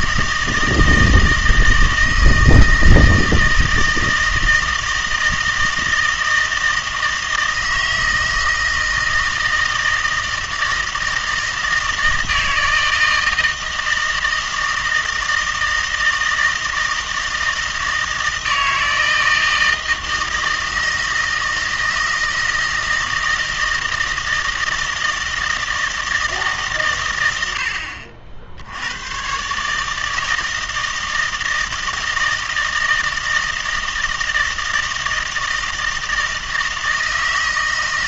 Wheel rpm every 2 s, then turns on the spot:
160, 160, 160, 160, 160, 160, 160, 160, 160, 160, 160, 160, 160, 140, 70, 160, 160, 160, 160.
none